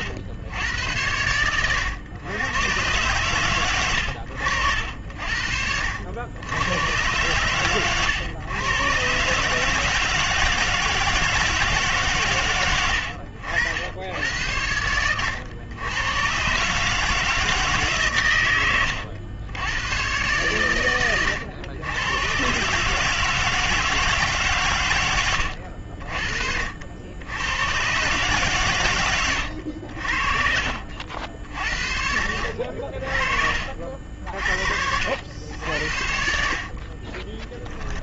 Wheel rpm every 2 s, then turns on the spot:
90, 120, 70, 120, 140, 160, 70, 100, 160, 90, 100, 150, 90, 70, 110, 70, 50, 70, 40.
24-26 36-38